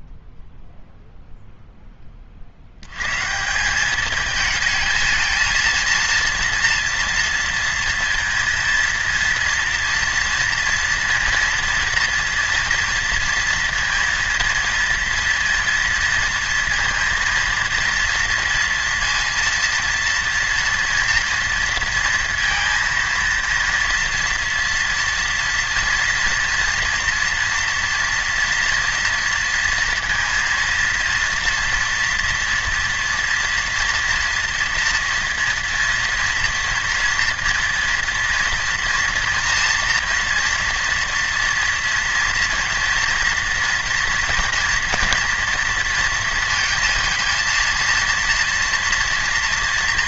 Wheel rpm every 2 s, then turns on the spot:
0, 50, 220, 230, 230, 230, 230, 230, 230, 230, 230, 230, 230, 240, 240, 230, 230, 230, 230, 240, 230, 230, 230, 230, 230.
none